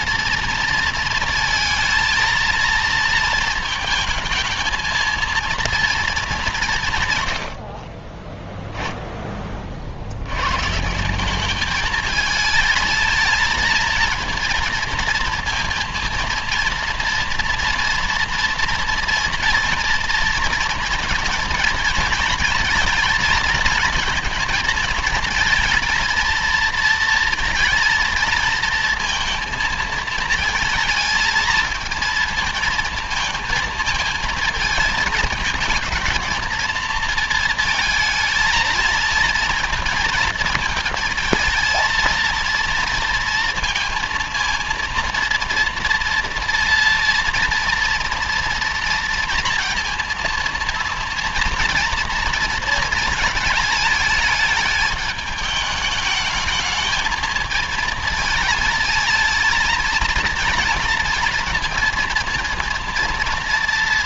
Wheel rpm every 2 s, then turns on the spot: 230, 230, 220, 160, 10, 160, 220, 230, 230, 240, 230, 220, 230, 230, 220, 220, 220, 220, 230, 220, 230, 230, 230, 230, 230, 230, 230, 210, 220, 220, 230, 230.
none